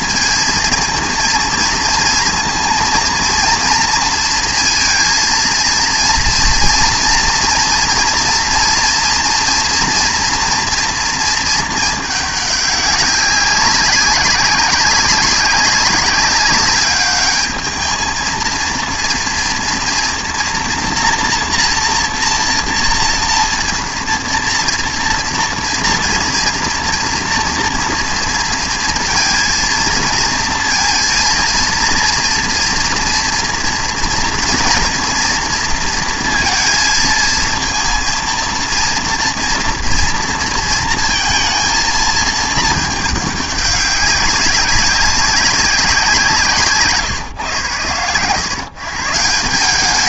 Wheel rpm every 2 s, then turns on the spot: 230, 230, 230, 230, 230, 230, 200, 190, 200, 230, 230, 230, 230, 240, 230, 230, 230, 230, 230, 230, 230, 220, 200, 160, 130.
none